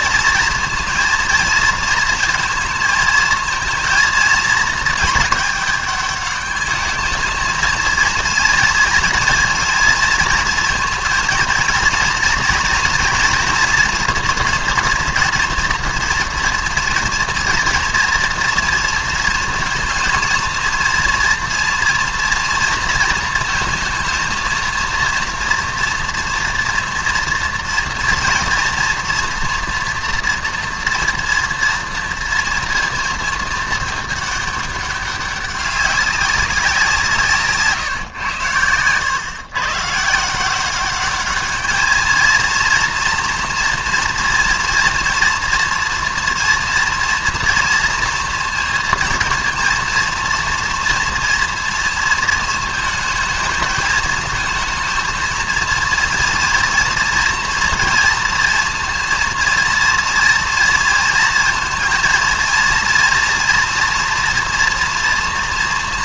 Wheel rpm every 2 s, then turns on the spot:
230, 230, 230, 200, 230, 230, 230, 240, 240, 230, 230, 240, 230, 230, 230, 230, 230, 210, 200, 130, 140, 220, 230, 230, 230, 230, 230, 220, 230, 230, 230, 230, 240.
none